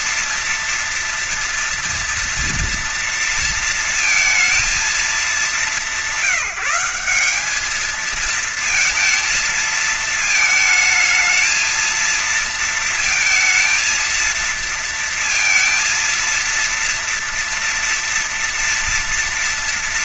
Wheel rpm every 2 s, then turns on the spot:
230, 230, 230, 190, 220, 220, 230, 230, 230, 230.
none